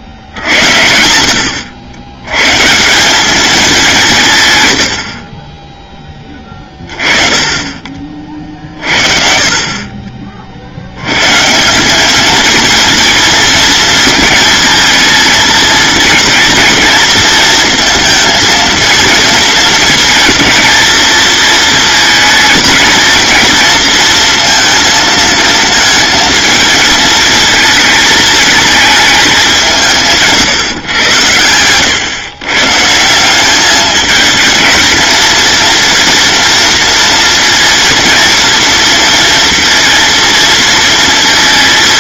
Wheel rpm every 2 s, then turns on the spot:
80, 190, 50, 30, 40, 130, 230, 220, 220, 230, 230, 230, 220, 230, 200, 110, 190, 230, 230, 230, 230.
none